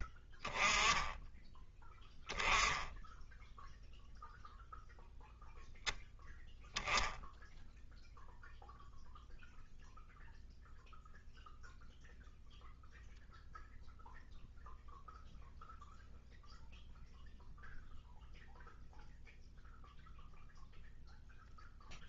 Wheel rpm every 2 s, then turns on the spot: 20, 10, 0, 0, 0, 0, 0, 0, 0, 0, 0.
none